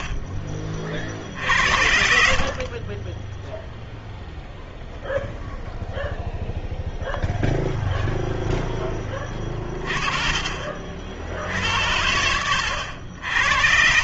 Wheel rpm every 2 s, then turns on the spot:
40, 40, 0, 0, 10, 60, 80.
none